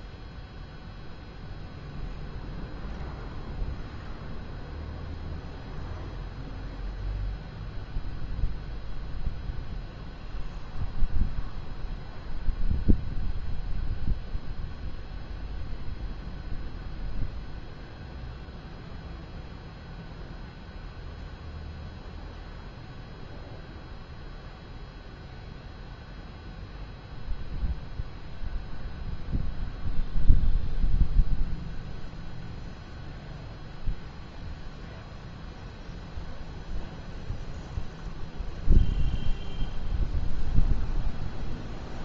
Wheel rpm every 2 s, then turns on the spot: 0, 0, 0, 0, 0, 0, 0, 0, 0, 0, 0, 0, 0, 0, 0, 0, 0, 0, 0, 0, 0.
none